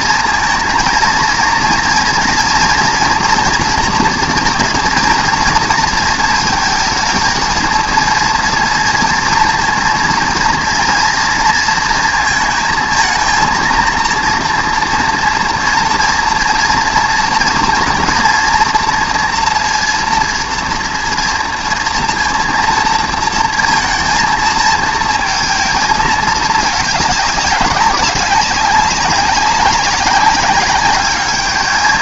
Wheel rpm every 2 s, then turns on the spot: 230, 230, 230, 230, 230, 230, 230, 230, 230, 230, 230, 230, 220, 210, 190, 200.
none